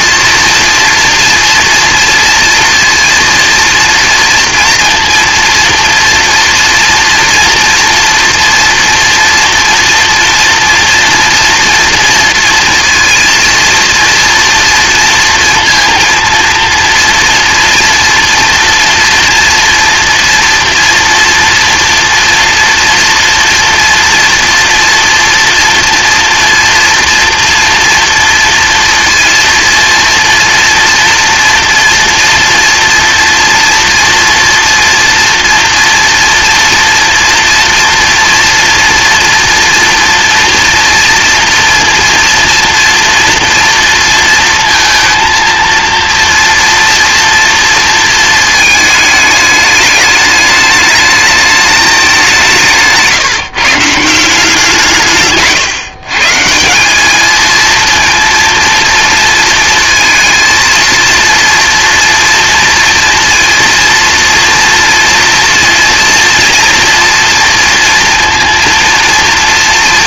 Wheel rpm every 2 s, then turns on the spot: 230, 230, 230, 230, 240, 230, 230, 230, 230, 230, 230, 230, 230, 230, 230, 230, 230, 230, 230, 230, 230, 230, 230, 230, 220, 210, 170, 160, 170, 230, 230, 230, 230, 230, 230.
none